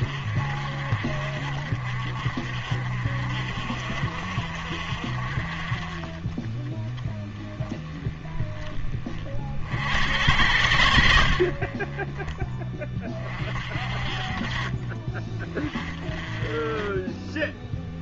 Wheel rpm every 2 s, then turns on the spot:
50, 50, 50, 20, 30, 80, 30, 40, 20.
none